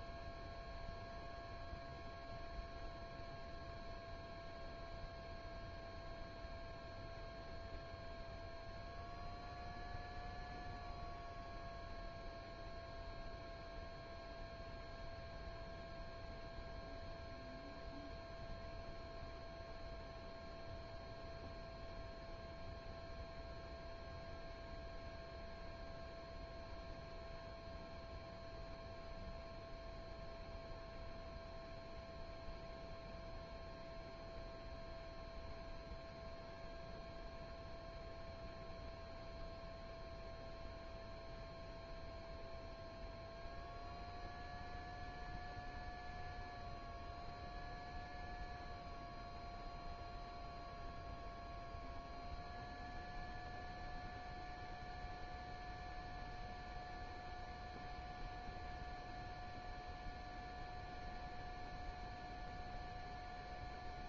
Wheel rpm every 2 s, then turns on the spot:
0, 0, 0, 0, 0, 0, 0, 0, 0, 0, 0, 0, 0, 0, 0, 0, 0, 0, 0, 0, 0, 0, 0, 0, 0, 0, 0, 0, 0, 0, 0, 0.
none